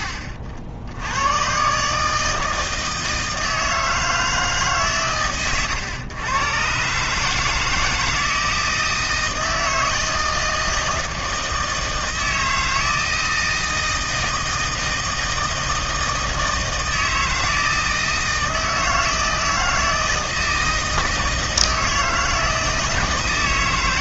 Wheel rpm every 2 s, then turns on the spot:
70, 160, 140, 120, 160, 160, 160, 160, 160, 160, 160, 160.
none